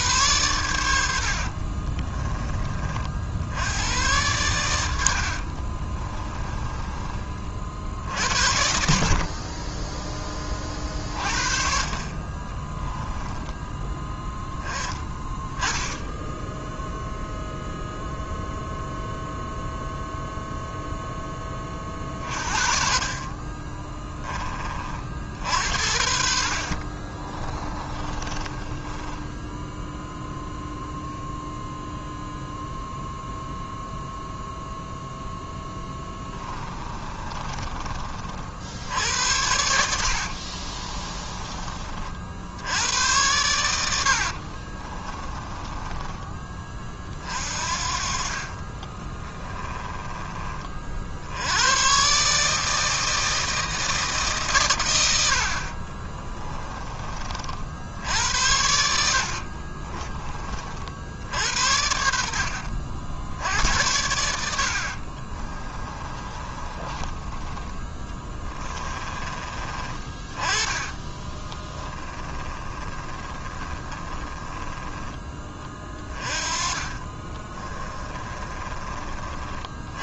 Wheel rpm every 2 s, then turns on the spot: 80, 50, 90, 30, 50, 40, 10, 20, 0, 0, 0, 40, 40, 30, 10, 0, 0, 0, 20, 70, 30, 90, 30, 30, 20, 50, 160, 100, 30, 70, 60, 60, 50, 20, 20, 20, 20, 10, 30, 30.
4-6 26-30 36-38 40-42 44-46 48-50 58-60 64-74 76-78